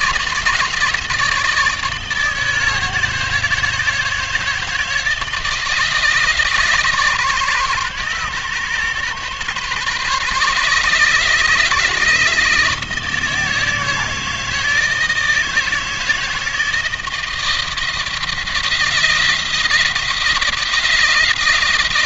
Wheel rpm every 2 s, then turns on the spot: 160, 160, 160, 140, 140, 150, 160, 160, 160, 170, 160.
none